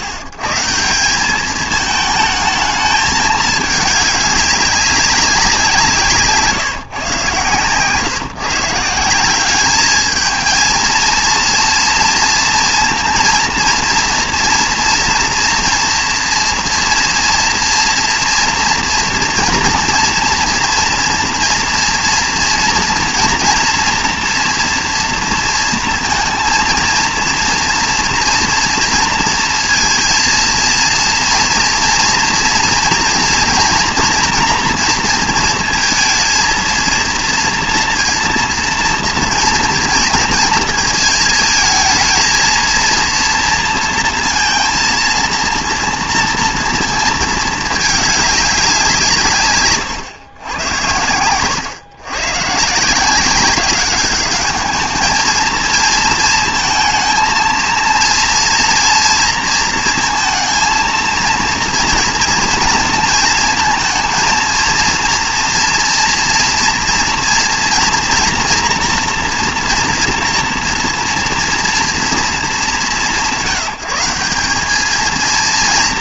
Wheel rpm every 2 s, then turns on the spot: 110, 220, 200, 150, 150, 220, 230, 230, 230, 230, 240, 230, 230, 230, 230, 230, 230, 240, 230, 230, 230, 220, 230, 230, 200, 100, 140, 200, 220, 230, 220, 230, 230, 230, 240, 230, 190, 190.
none